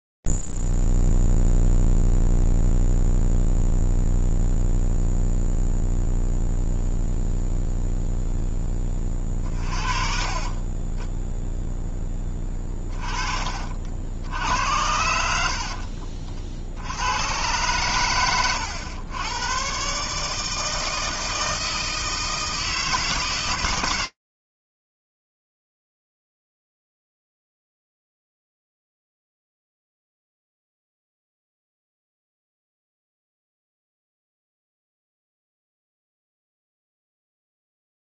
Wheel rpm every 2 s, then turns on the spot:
0, 0, 0, 0, 0, 30, 20, 90, 70, 100, 160, 160, 160, 90, 40, 20, 140, 160, 110.
12-14